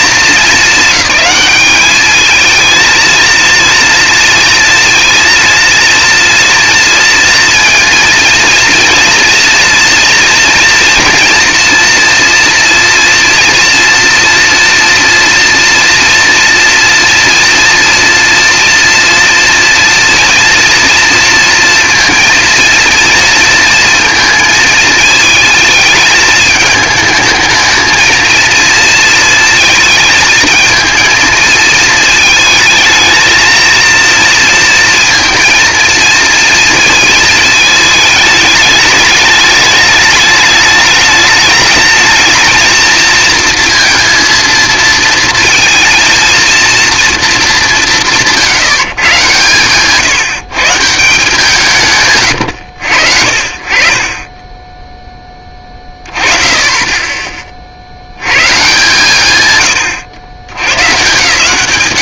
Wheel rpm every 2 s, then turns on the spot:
210, 230, 230, 230, 240, 230, 230, 230, 230, 230, 230, 230, 220, 220, 230, 230, 220, 230, 230, 210, 210, 220, 220, 230, 130, 160, 60, 10, 10, 140, 110.
none